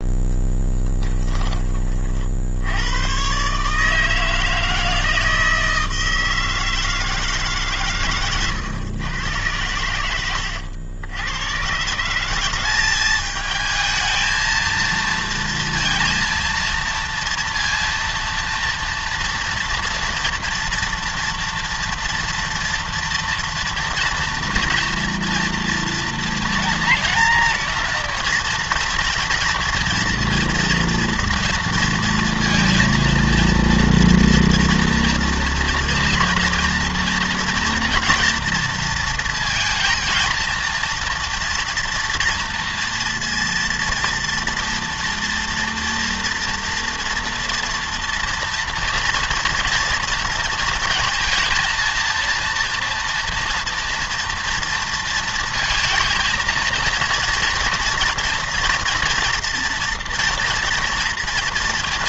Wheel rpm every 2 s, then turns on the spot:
10, 80, 160, 160, 110, 80, 190, 230, 230, 230, 230, 230, 240, 240, 230, 230, 230, 230, 230, 230, 230, 230, 230, 230, 230, 230, 230, 230, 230, 230, 230.
0-2